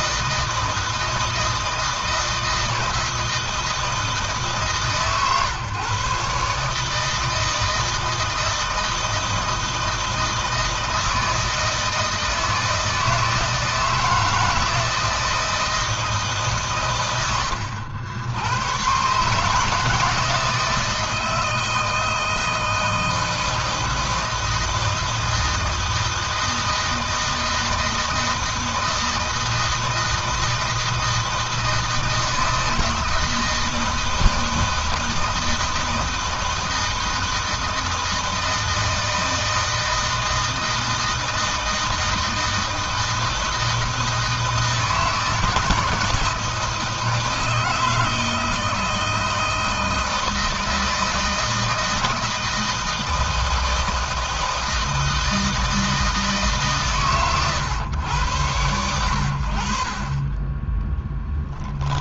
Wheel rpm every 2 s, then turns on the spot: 160, 160, 150, 140, 160, 160, 160, 160, 140, 110, 160, 160, 160, 160, 160, 160, 160, 160, 160, 160, 160, 160, 160, 170, 160, 160, 160, 160, 150, 100, 20.
60-62